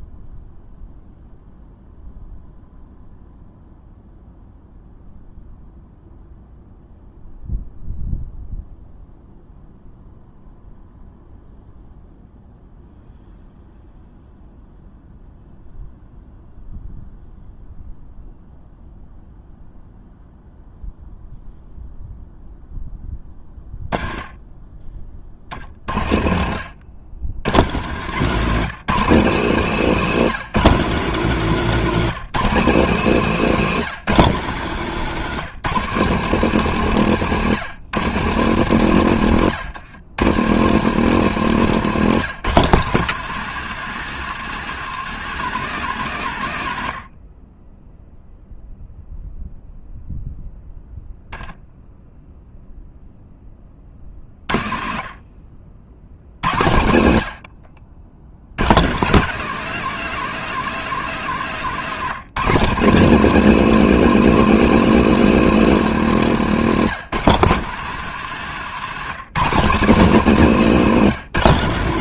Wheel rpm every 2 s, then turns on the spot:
0, 0, 0, 0, 0, 0, 0, 0, 0, 0, 0, 10, 30, 80, 190, 200, 190, 170, 170, 150, 190, 190, 210, 100, 0, 0, 0, 50, 90, 150, 190, 190, 220, 190, 190, 190.
none